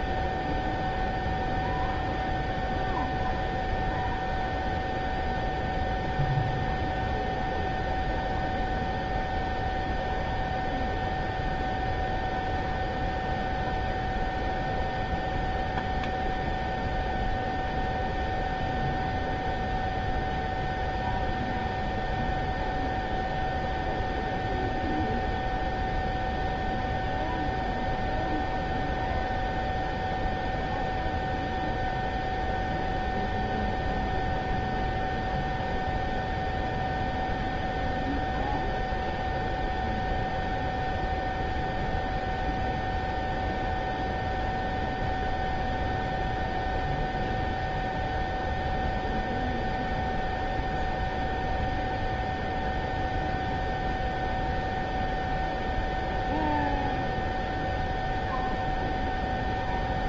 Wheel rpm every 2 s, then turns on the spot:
0, 0, 0, 0, 0, 0, 0, 0, 0, 0, 0, 0, 0, 0, 0, 0, 0, 0, 0, 0, 0, 0, 0, 0, 0, 0, 0, 0, 0, 0.
none